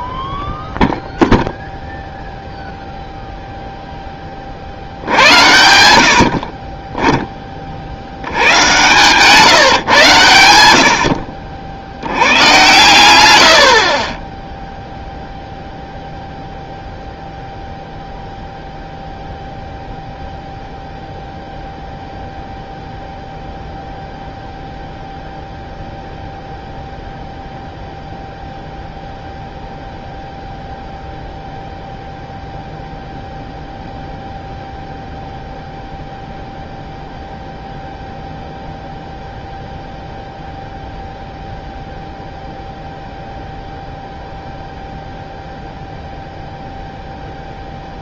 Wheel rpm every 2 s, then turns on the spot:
0, 0, 40, 40, 100, 80, 110, 0, 0, 0, 0, 0, 0, 0, 0, 0, 0, 0, 0, 0, 0, 0, 0, 0.
8-10